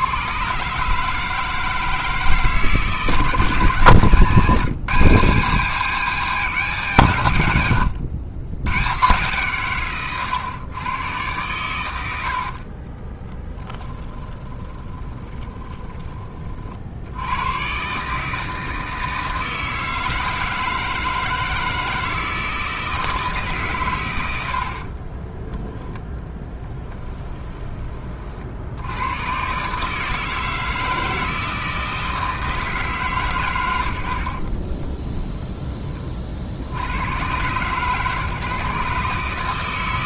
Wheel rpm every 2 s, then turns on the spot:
150, 150, 160, 160, 120, 110, 30, 20, 60, 160, 160, 160, 40, 10, 80, 160, 150, 20, 50, 130.
12-16 24-28 34-36